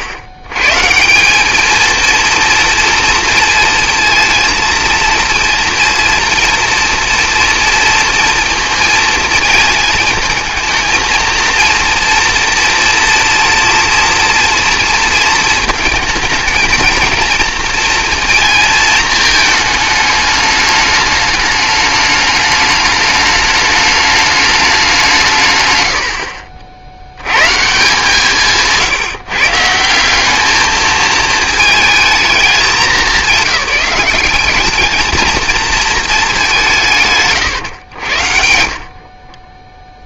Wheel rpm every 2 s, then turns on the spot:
120, 230, 230, 230, 230, 220, 240, 230, 230, 230, 210, 210, 200, 60, 150, 220, 220, 210, 180, 50.
none